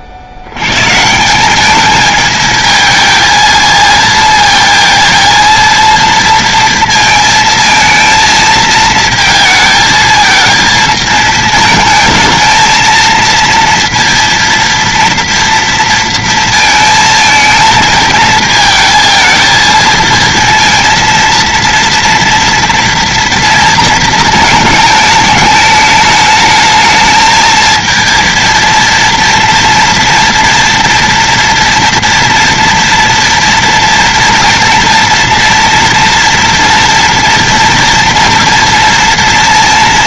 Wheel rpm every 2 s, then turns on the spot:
130, 220, 230, 230, 220, 220, 220, 230, 230, 220, 230, 230, 210, 220, 230, 240, 230, 230, 230, 230.
none